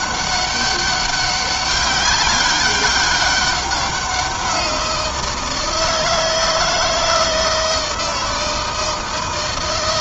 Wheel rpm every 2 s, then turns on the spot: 200, 200, 170, 160, 160.
none